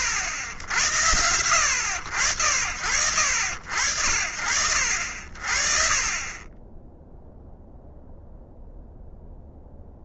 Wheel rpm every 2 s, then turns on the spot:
70, 70, 60, 20, 0.
none